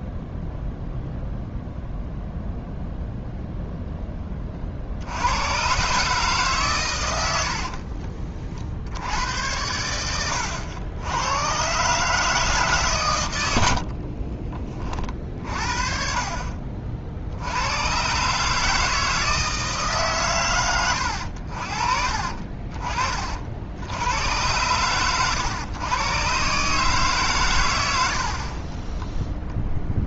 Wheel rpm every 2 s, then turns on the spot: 0, 0, 30, 130, 40, 90, 150, 40, 50, 150, 110, 40, 100, 140, 40.
10-12 28-30